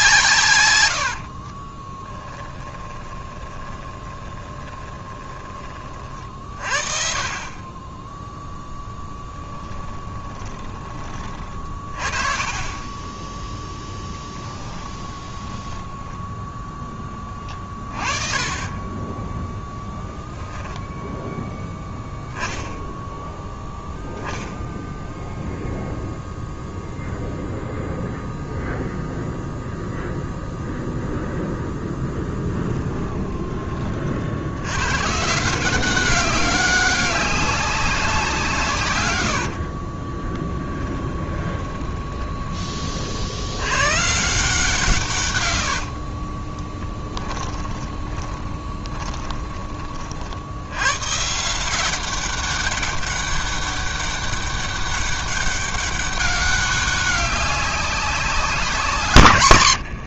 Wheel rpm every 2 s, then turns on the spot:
120, 20, 20, 50, 0, 20, 30, 10, 10, 20, 10, 0, 0, 0, 0, 0, 10, 90, 190, 150, 10, 30, 170, 30, 20, 80, 200, 200, 200, 190.
2-6 10-12 14-16 20-22 32-34 40-42 46-50